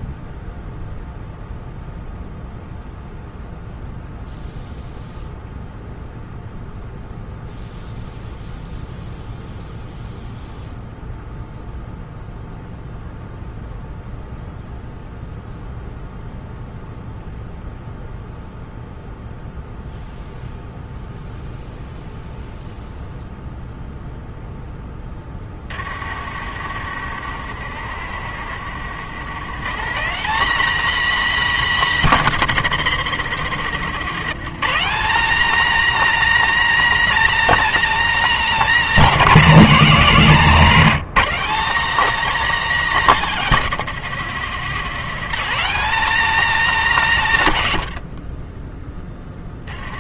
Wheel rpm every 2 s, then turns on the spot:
0, 0, 0, 0, 0, 0, 0, 0, 0, 0, 0, 0, 10, 70, 90, 250, 190, 220, 270, 220, 190, 240, 200, 210, 20.
none